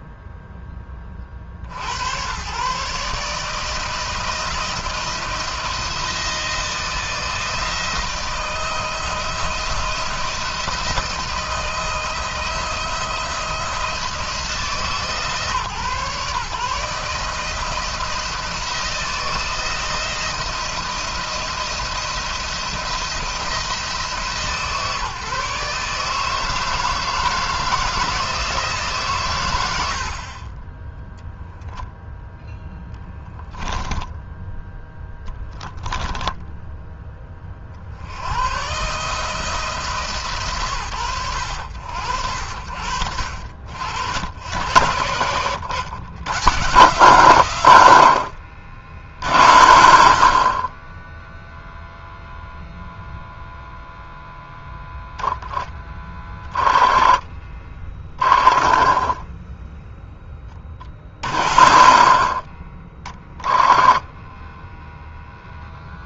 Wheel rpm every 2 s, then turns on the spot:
10, 130, 160, 170, 160, 160, 170, 160, 150, 160, 170, 170, 150, 160, 140, 10, 0, 10, 10, 130, 130, 70, 80, 120, 80, 40, 0, 0, 10, 10, 20, 50, 0.
30-32 56-60